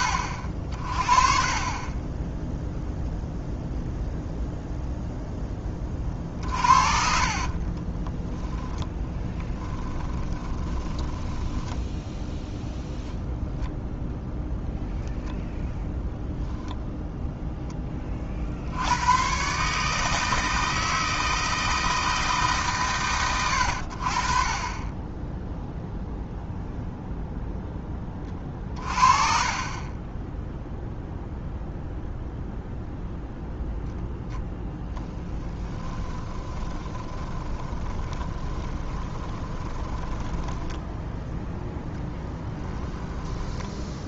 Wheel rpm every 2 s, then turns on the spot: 50, 0, 0, 50, 10, 20, 0, 10, 0, 90, 160, 140, 20, 0, 40, 0, 0, 10, 20, 20, 10, 20.
6-12 24-26 36-44